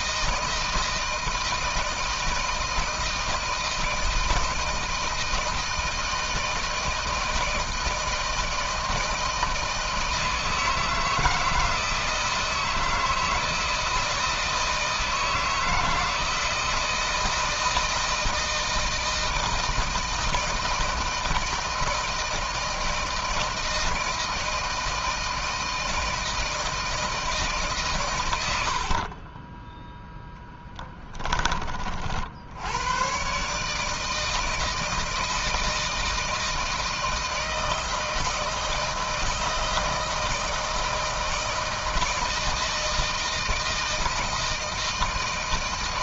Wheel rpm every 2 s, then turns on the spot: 160, 160, 160, 160, 160, 160, 160, 160, 160, 160, 160, 160, 160, 160, 50, 10, 100, 160, 160, 160, 160, 160, 160.
28-30